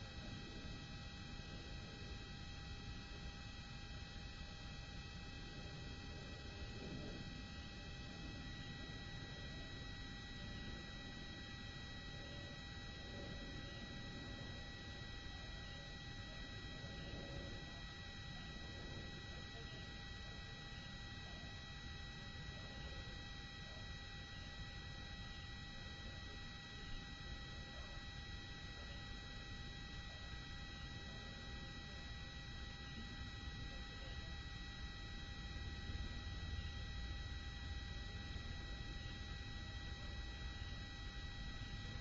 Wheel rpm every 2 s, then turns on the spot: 0, 0, 0, 0, 0, 0, 0, 0, 0, 0, 0, 0, 0, 0, 0, 0, 0, 0, 0, 0, 0.
none